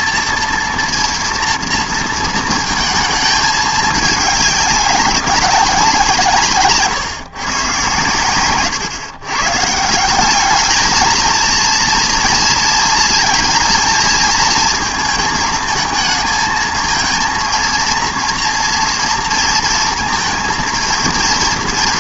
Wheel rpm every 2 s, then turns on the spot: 230, 220, 210, 160, 120, 210, 230, 220, 220, 230, 220.
none